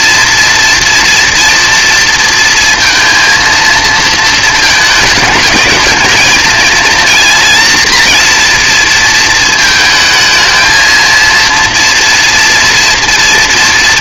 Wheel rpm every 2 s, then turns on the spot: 230, 230, 230, 230, 240, 220, 230.
none